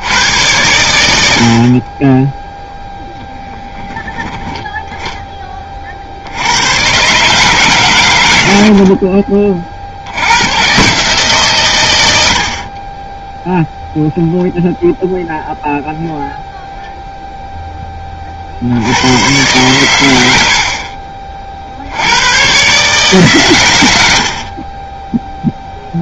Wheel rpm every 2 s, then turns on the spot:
110, 0, 10, 100, 70, 120, 60, 0, 0, 60, 70, 130, 30.
none